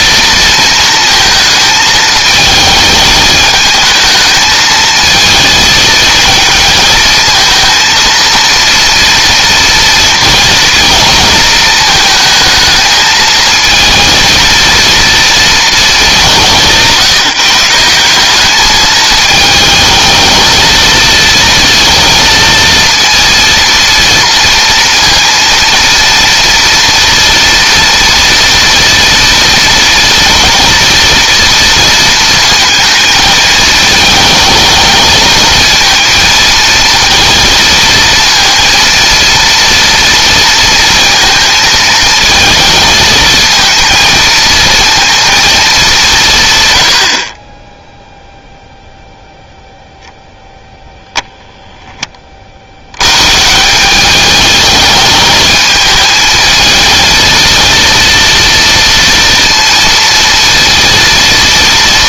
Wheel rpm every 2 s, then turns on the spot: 230, 220, 220, 220, 230, 230, 220, 230, 170, 220, 230, 230, 230, 230, 230, 240, 220, 220, 230, 230, 230, 220, 230, 90, 0, 0, 90, 220, 220, 230, 230.
none